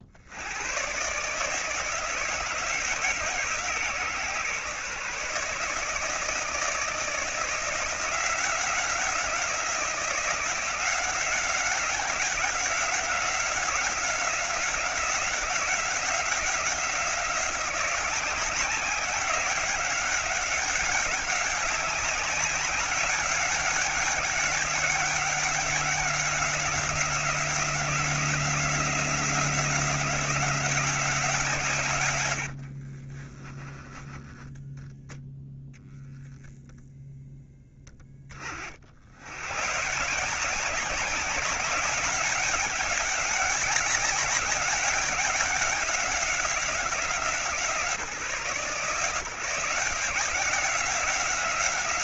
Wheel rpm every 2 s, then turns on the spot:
110, 150, 150, 160, 180, 180, 190, 180, 180, 190, 190, 200, 190, 180, 180, 180, 50, 10, 0, 60, 180, 200, 200, 180, 140, 180.
32-34